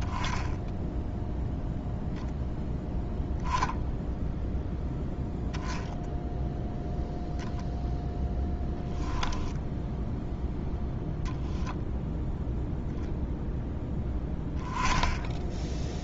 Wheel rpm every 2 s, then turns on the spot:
0, 0, 0, 0, 10, 0, 0, 10.
8-10